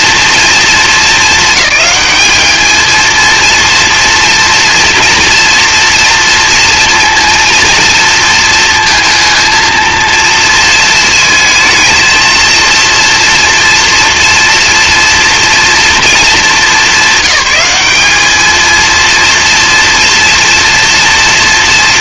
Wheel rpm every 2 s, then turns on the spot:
220, 220, 230, 230, 230, 230, 230, 240, 200, 230, 230.
none